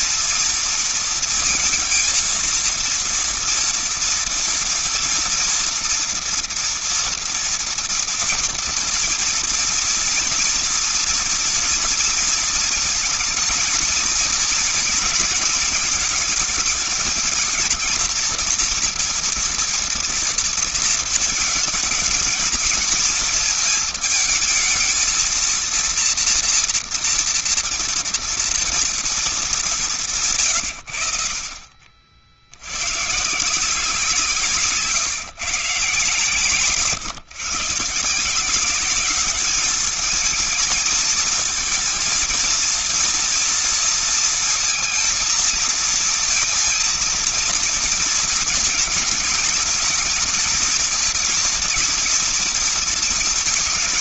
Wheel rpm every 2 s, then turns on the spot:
230, 230, 230, 230, 240, 230, 230, 230, 220, 240, 230, 220, 220, 230, 230, 140, 70, 160, 150, 180, 220, 230, 230, 220, 230, 220, 230.
none